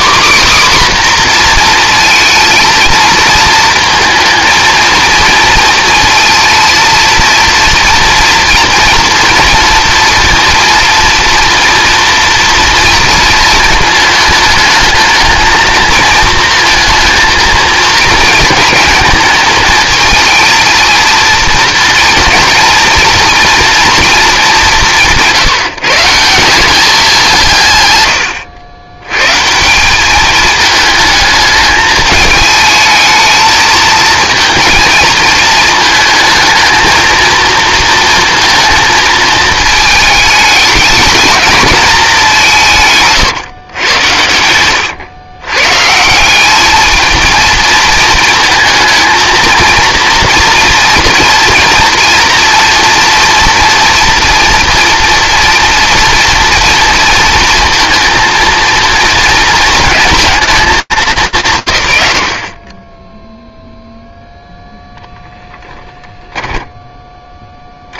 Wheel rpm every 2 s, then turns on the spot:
270, 230, 230, 230, 230, 230, 230, 220, 220, 220, 230, 230, 180, 190, 100, 220, 220, 230, 230, 220, 220, 170, 100, 220, 230, 230, 230, 230, 230, 230, 200, 20, 0, 10.
44-46